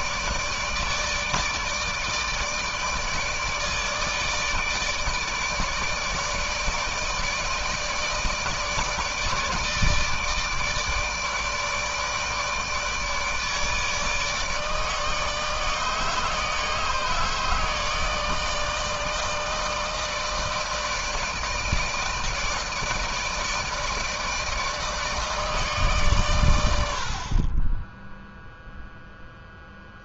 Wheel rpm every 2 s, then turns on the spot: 160, 160, 160, 150, 160, 150, 150, 150, 150, 160, 160, 150, 160, 100, 0.
none